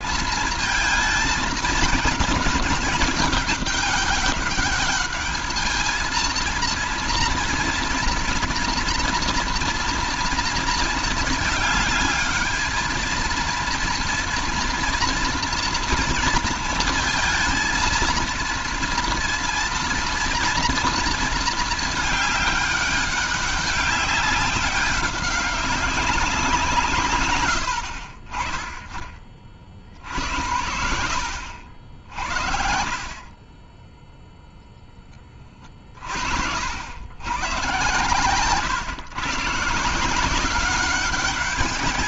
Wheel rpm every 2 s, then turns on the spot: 220, 220, 200, 230, 230, 230, 220, 230, 230, 230, 230, 200, 200, 180, 40, 70, 60, 0, 70, 130, 190.
30-32